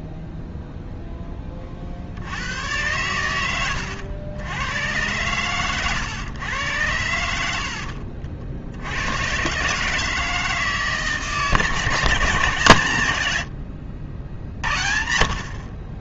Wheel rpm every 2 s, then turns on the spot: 0, 100, 100, 100, 80, 160, 140, 60.
none